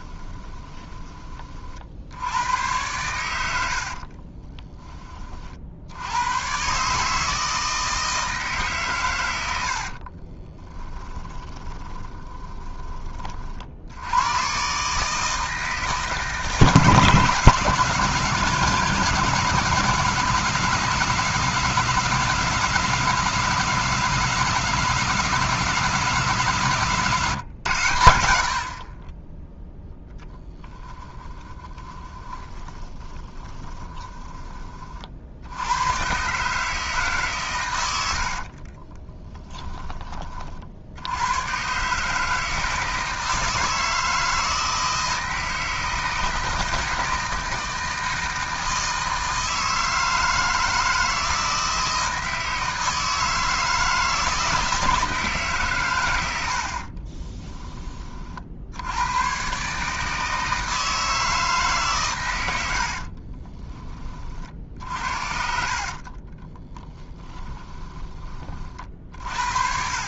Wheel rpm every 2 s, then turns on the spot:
20, 100, 20, 140, 140, 20, 20, 140, 150, 180, 170, 170, 180, 150, 50, 10, 30, 30, 150, 30, 60, 160, 160, 160, 160, 160, 160, 160, 60, 80, 160, 70, 60, 10, 40.
0-2 10-14 32-34 38-40 62-64 66-68